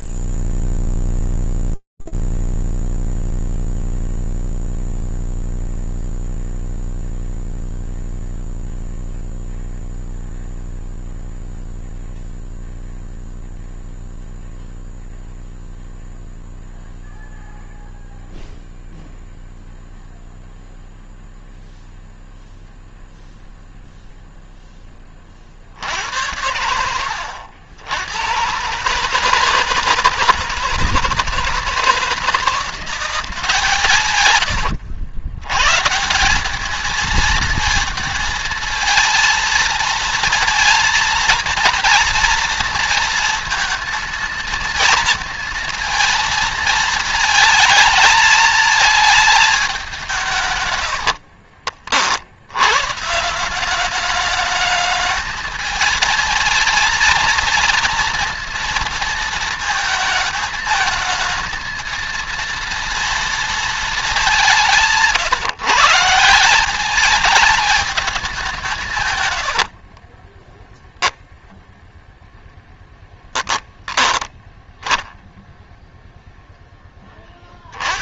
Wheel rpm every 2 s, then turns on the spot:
0, 0, 0, 0, 0, 0, 0, 0, 0, 0, 0, 0, 10, 90, 130, 160, 170, 90, 200, 230, 230, 230, 230, 220, 220, 130, 80, 210, 230, 230, 220, 230, 160, 180, 180, 20, 0, 10, 10.
34-36